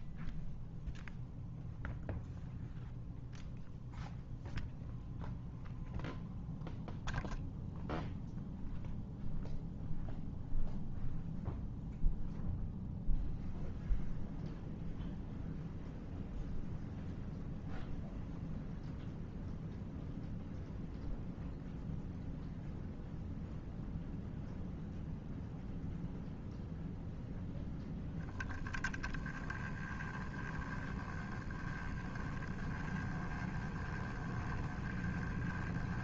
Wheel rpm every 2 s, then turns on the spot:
0, 0, 0, 0, 0, 0, 0, 0, 0, 0, 0, 0, 0, 0, 10, 10, 10, 10.
none